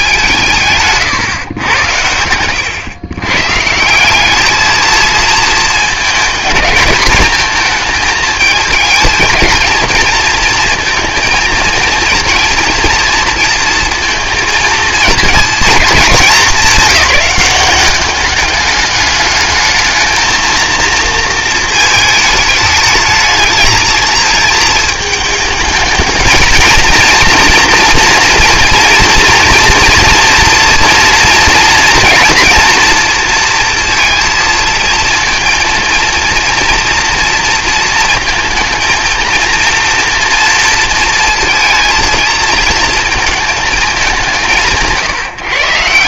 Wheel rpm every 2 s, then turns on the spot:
150, 120, 220, 220, 220, 230, 230, 220, 200, 210, 230, 210, 220, 230, 230, 230, 230, 230, 230, 220, 230, 220, 160.
none